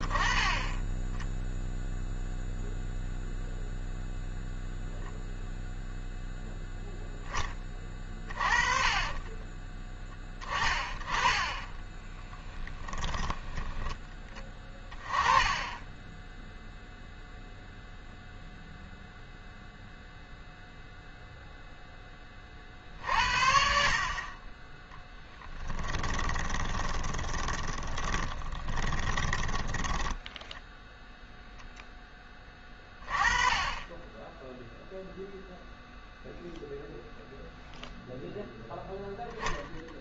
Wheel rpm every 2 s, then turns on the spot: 10, 0, 0, 0, 20, 30, 10, 20, 0, 0, 0, 50, 10, 20, 20, 0, 30, 0, 0, 0.
8-14 26-30